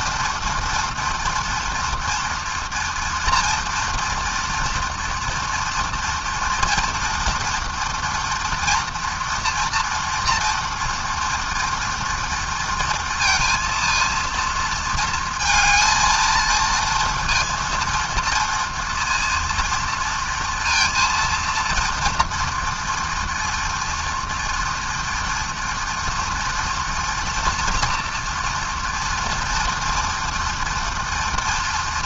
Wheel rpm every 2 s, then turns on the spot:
230, 240, 240, 230, 230, 230, 230, 230, 230, 230, 230, 230, 240, 230, 240, 230.
none